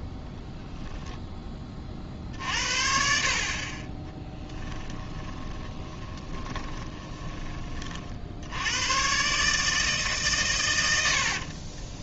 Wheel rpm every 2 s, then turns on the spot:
0, 50, 10, 20, 80, 120.
4-8